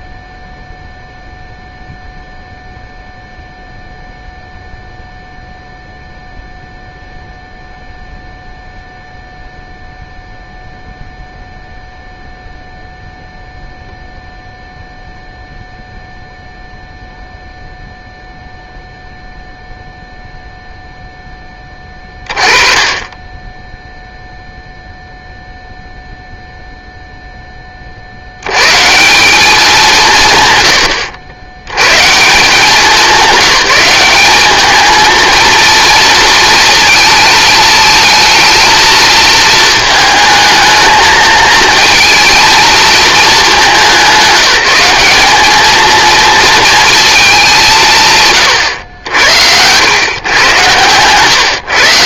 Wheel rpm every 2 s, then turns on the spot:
0, 0, 0, 0, 0, 0, 0, 0, 0, 0, 0, 30, 0, 0, 130, 110, 190, 210, 230, 230, 220, 230, 190, 230, 110, 130.
none